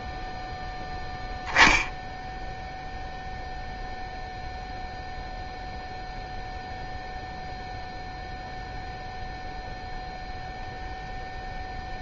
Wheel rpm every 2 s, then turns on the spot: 0, 0, 0, 0, 0, 0.
none